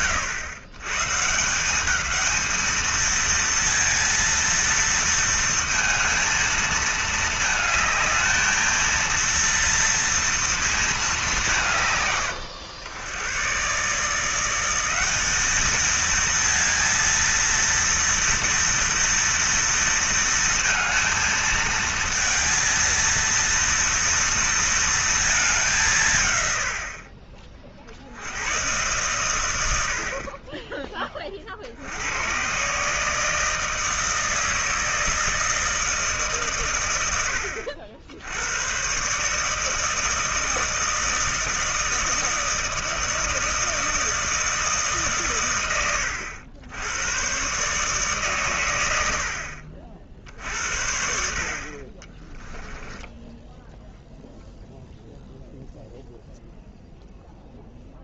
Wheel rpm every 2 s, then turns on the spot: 130, 220, 230, 220, 230, 220, 100, 190, 230, 230, 230, 230, 230, 70, 120, 30, 140, 160, 120, 130, 160, 160, 150, 100, 110, 70, 10, 0, 0.
52-54